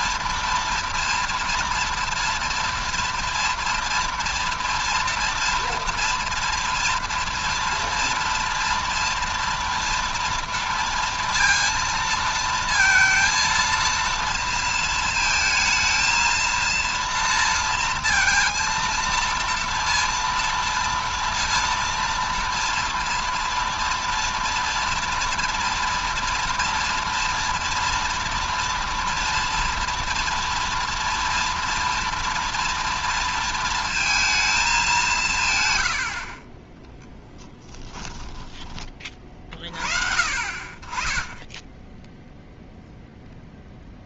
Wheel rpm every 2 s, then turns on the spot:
230, 230, 230, 230, 230, 230, 230, 230, 230, 230, 230, 230, 230, 230, 230, 230, 230, 220, 40, 20, 40, 0.
none